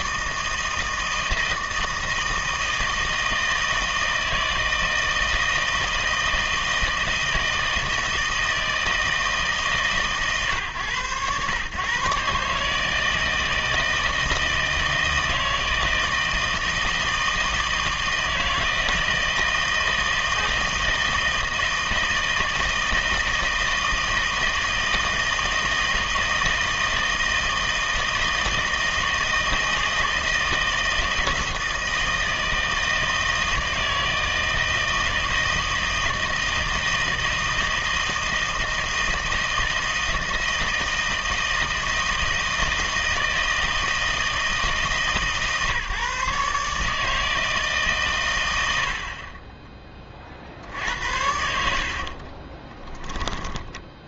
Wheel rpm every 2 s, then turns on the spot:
160, 160, 160, 160, 160, 120, 150, 160, 160, 160, 160, 160, 160, 160, 160, 160, 160, 160, 160, 160, 160, 160, 160, 150, 80, 60, 30.
52-54